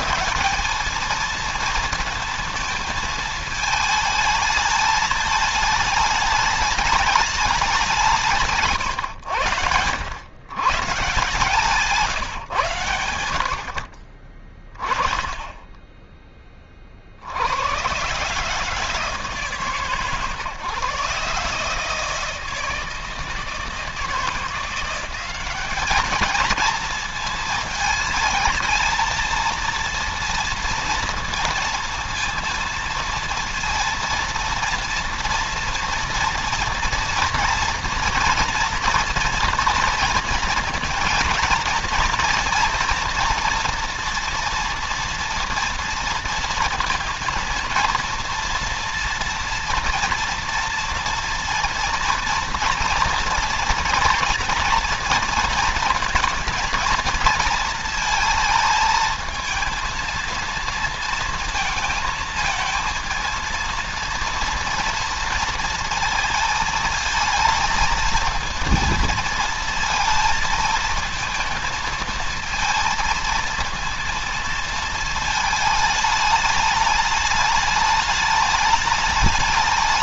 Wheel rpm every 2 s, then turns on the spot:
190, 220, 220, 210, 150, 140, 110, 20, 40, 160, 140, 160, 180, 230, 220, 230, 230, 230, 230, 230, 230, 230, 230, 230, 230, 230, 230, 230, 230, 220, 230, 230, 230, 220, 230, 220, 230, 230, 210, 210.
14-16